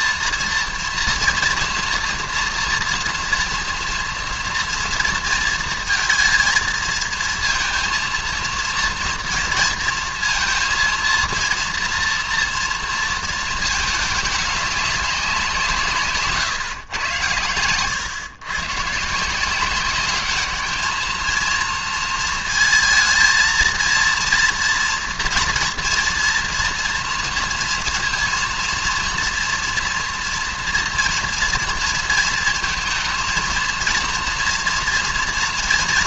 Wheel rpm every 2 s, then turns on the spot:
230, 240, 230, 230, 230, 230, 230, 200, 130, 120, 210, 230, 230, 230, 230, 230, 220, 230.
none